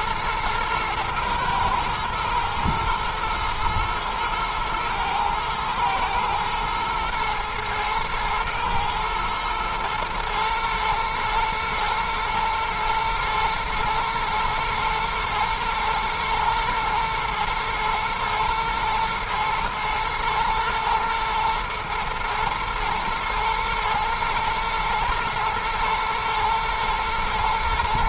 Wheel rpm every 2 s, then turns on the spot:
120, 110, 110, 110, 120, 110, 120, 120, 120, 120, 110, 110, 110, 110.
none